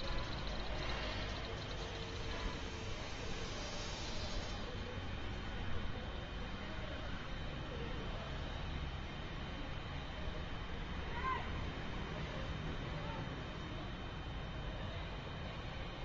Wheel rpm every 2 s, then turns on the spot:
0, 0, 0, 0, 0, 0, 0, 0.
none